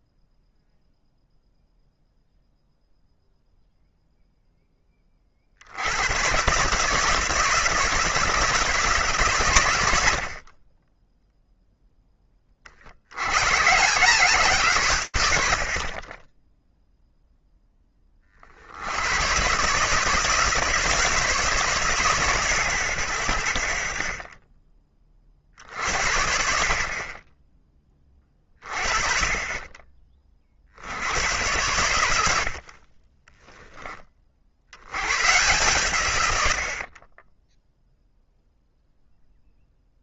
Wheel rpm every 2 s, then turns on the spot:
0, 0, 20, 150, 150, 10, 60, 120, 0, 80, 160, 110, 30, 40, 30, 70, 20, 120, 20, 0.
none